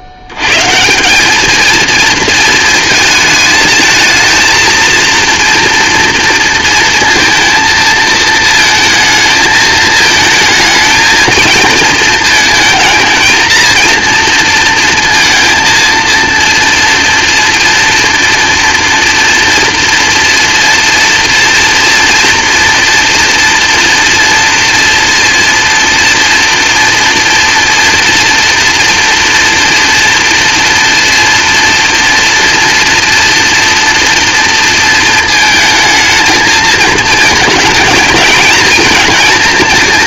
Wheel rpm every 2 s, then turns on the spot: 130, 220, 230, 230, 220, 220, 220, 230, 230, 230, 240, 240, 230, 240, 240, 230, 230, 230, 220, 220.
none